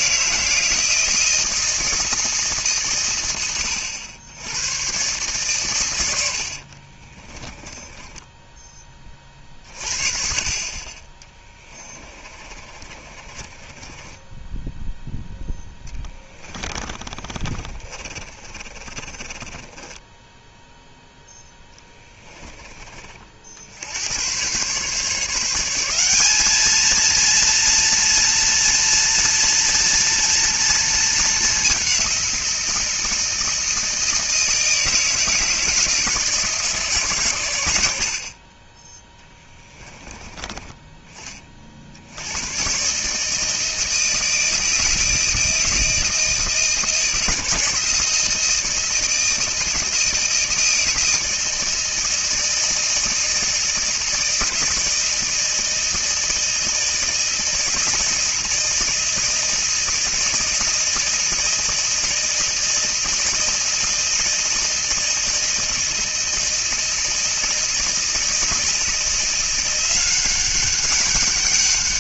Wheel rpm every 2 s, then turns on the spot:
160, 130, 110, 40, 20, 30, 30, 0, 20, 40, 0, 30, 140, 230, 230, 220, 170, 160, 150, 20, 20, 130, 160, 160, 160, 160, 160, 160, 160, 160, 160, 160, 160, 160, 160, 190.
6-8 12-14 16-20 38-40